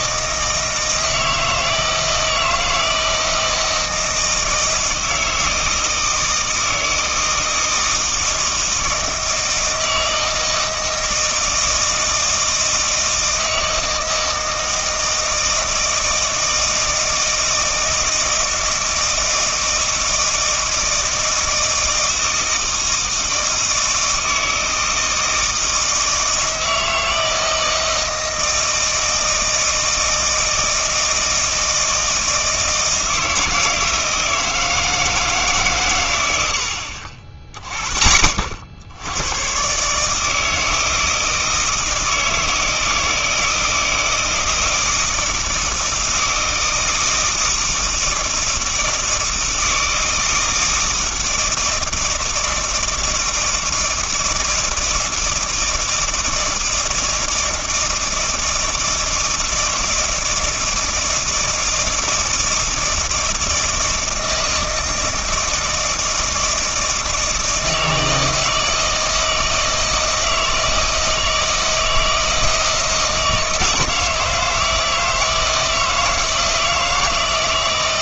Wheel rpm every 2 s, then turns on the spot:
160, 160, 160, 160, 160, 160, 160, 160, 160, 160, 160, 160, 160, 160, 160, 160, 160, 160, 80, 70, 160, 160, 160, 160, 160, 160, 160, 160, 160, 160, 160, 160, 160, 160, 160, 160, 160, 160, 160.
none